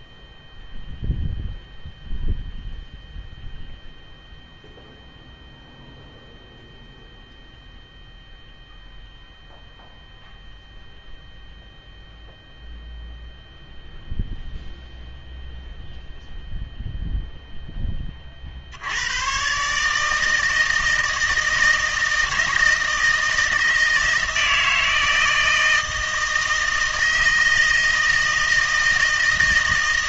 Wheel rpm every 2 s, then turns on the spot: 0, 0, 0, 0, 0, 0, 0, 0, 0, 70, 160, 160, 160, 160, 160.
none